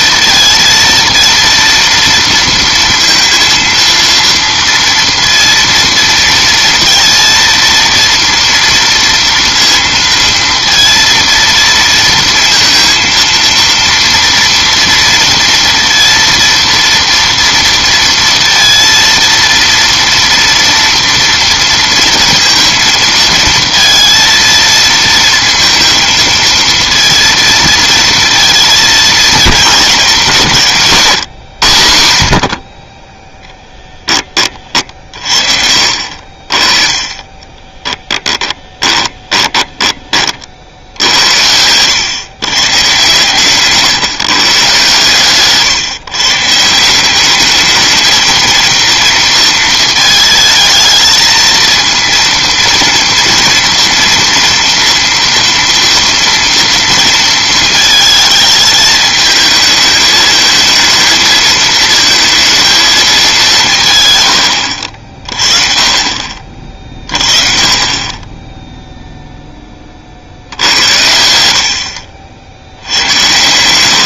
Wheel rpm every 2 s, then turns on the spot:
230, 230, 230, 230, 230, 230, 230, 230, 230, 230, 230, 230, 230, 230, 230, 160, 50, 40, 30, 20, 60, 130, 130, 160, 230, 220, 230, 230, 230, 220, 220, 220, 80, 40, 0, 90, 80.
38-40